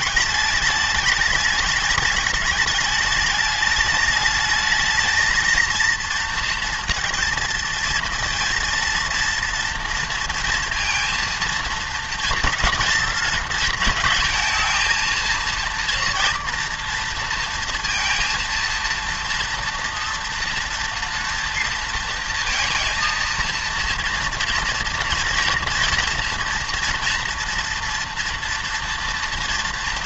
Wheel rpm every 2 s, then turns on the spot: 210, 210, 220, 230, 230, 230, 230, 220, 230, 230, 230, 230, 230, 230, 230.
none